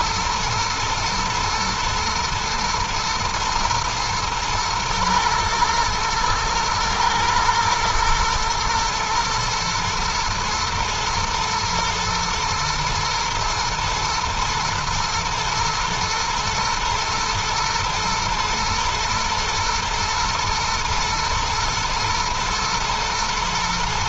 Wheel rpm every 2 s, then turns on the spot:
110, 120, 110, 120, 110, 120, 110, 120, 110, 110, 120, 110.
none